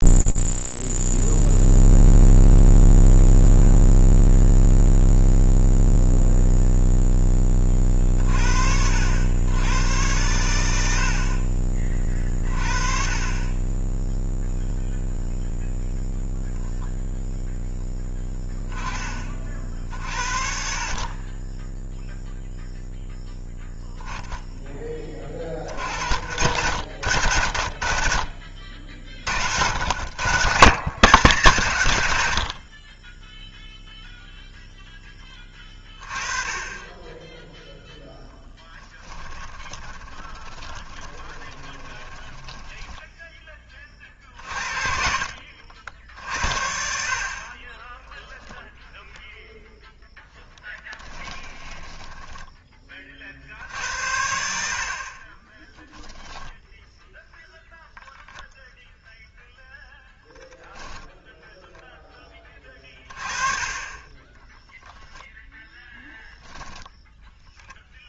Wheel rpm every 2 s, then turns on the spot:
0, 0, 0, 0, 70, 80, 30, 0, 0, 10, 50, 0, 20, 70, 50, 130, 40, 0, 20, 10, 20, 10, 50, 60, 0, 10, 10, 60, 0, 0, 0, 20, 10, 0.
38-42 50-52